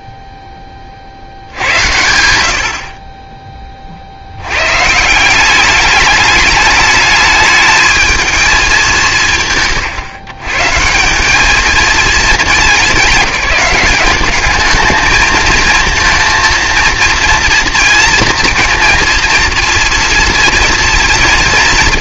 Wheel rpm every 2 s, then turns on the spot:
30, 70, 120, 210, 200, 160, 190, 210, 230, 230, 230.
none